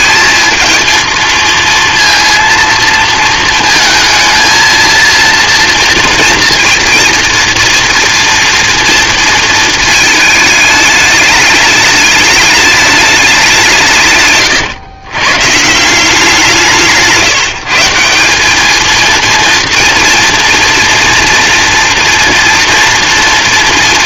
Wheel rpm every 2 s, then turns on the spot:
220, 230, 230, 230, 230, 210, 210, 120, 160, 220, 230, 230.
none